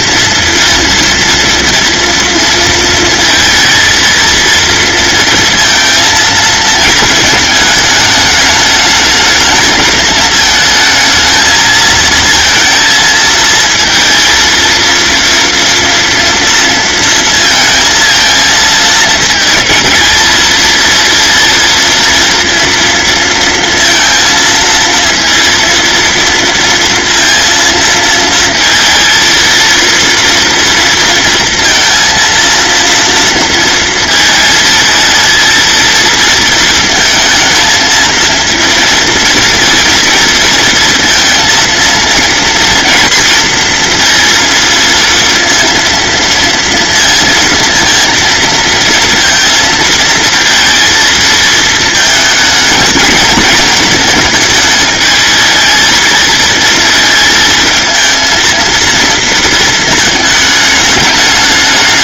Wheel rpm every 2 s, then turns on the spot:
230, 230, 230, 220, 210, 220, 230, 230, 230, 220, 230, 230, 230, 230, 230, 230, 230, 220, 230, 230, 230, 230, 230, 230, 230, 230, 220, 220, 220, 230, 210.
none